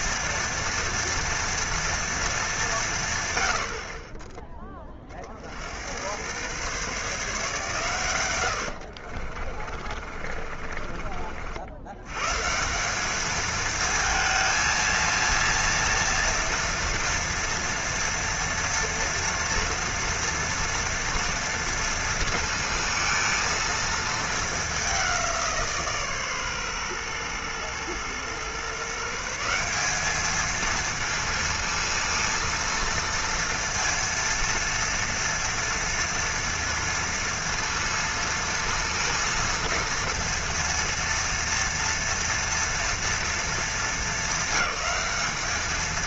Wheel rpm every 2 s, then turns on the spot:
230, 190, 20, 130, 80, 40, 180, 230, 230, 240, 230, 230, 210, 130, 140, 230, 230, 230, 230, 230, 230, 230, 210.
8-12